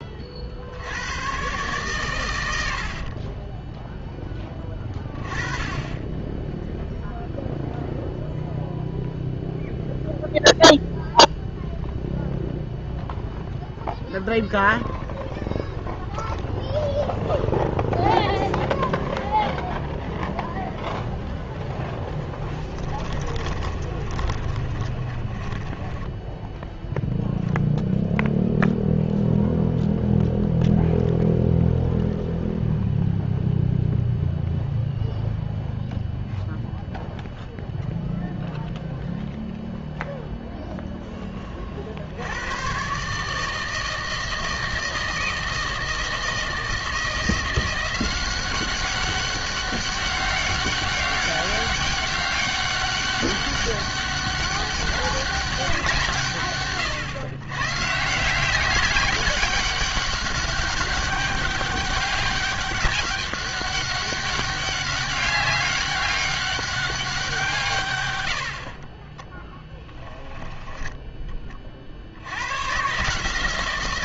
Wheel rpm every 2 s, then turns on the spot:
70, 70, 10, 0, 0, 0, 0, 0, 0, 0, 0, 10, 20, 10, 0, 0, 0, 0, 0, 0, 0, 120, 160, 160, 190, 200, 200, 200, 120, 190, 190, 200, 200, 200, 50, 20, 120.
22-26 70-72